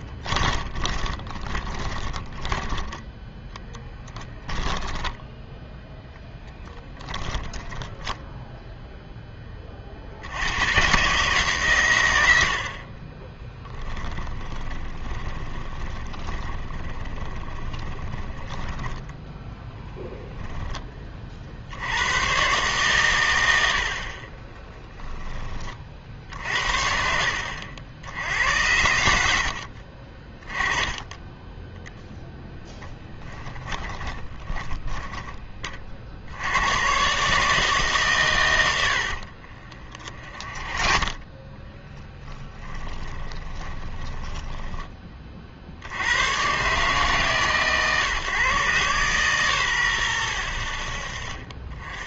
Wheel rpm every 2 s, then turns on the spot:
30, 10, 10, 10, 0, 100, 60, 20, 20, 10, 10, 120, 20, 70, 90, 20, 10, 10, 100, 100, 30, 20, 10, 130, 130, 70.
0-6 14-20 24-26 34-36 40-46